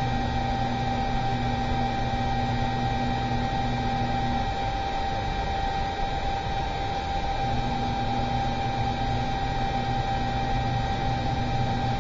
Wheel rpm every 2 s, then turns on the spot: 0, 0, 0, 0, 0, 0.
none